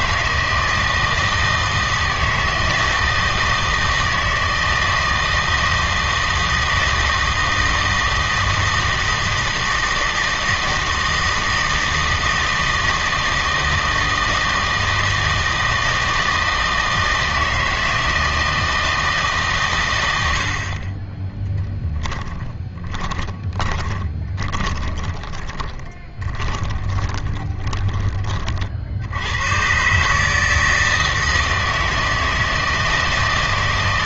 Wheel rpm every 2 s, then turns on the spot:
160, 160, 160, 160, 160, 160, 160, 160, 160, 160, 50, 20, 30, 20, 50, 160, 160.
22-28